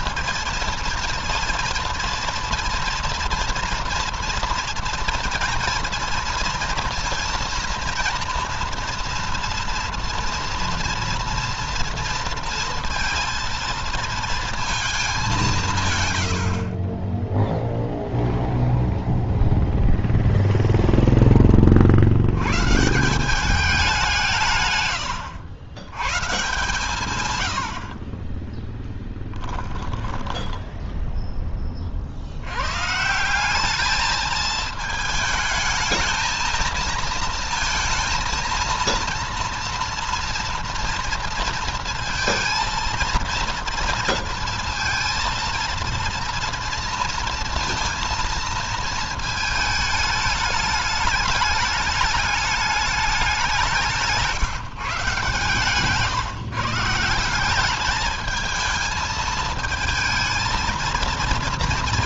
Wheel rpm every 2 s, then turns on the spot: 230, 230, 230, 240, 240, 230, 230, 210, 30, 0, 0, 160, 100, 150, 10, 10, 120, 220, 220, 230, 230, 230, 230, 230, 220, 210, 200, 130, 160, 220, 230.
24-26 28-30